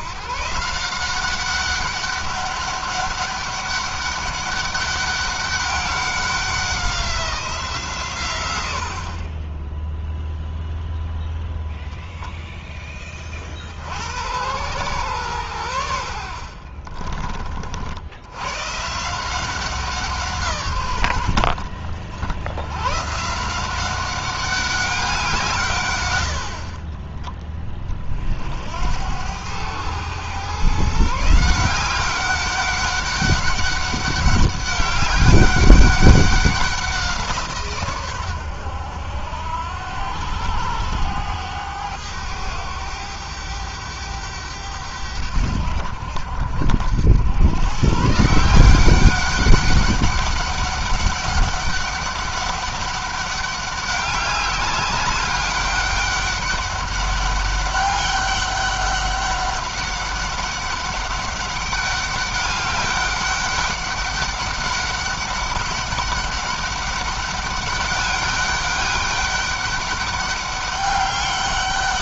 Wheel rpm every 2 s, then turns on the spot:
180, 200, 200, 190, 70, 0, 10, 110, 50, 150, 120, 140, 180, 30, 80, 140, 200, 200, 180, 90, 100, 100, 90, 90, 180, 200, 200, 200, 200, 200, 200, 200, 200, 200, 200, 200.
16-18